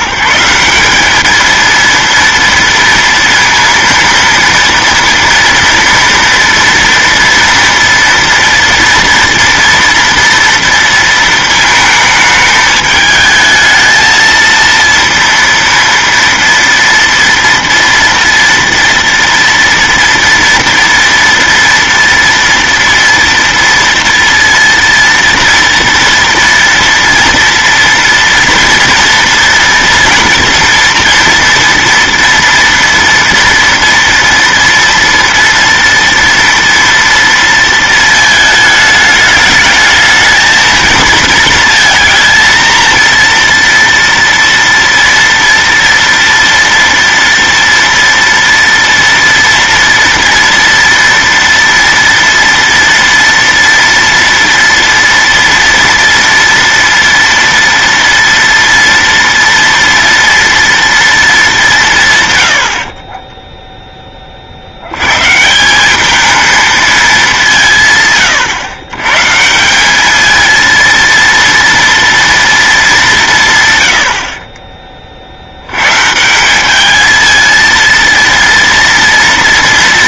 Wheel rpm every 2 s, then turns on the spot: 190, 230, 230, 230, 230, 230, 210, 230, 230, 230, 230, 230, 230, 230, 230, 230, 230, 230, 230, 210, 220, 230, 230, 230, 230, 230, 230, 230, 230, 230, 230, 70, 70, 220, 120, 220, 220, 20, 190, 230.
62-64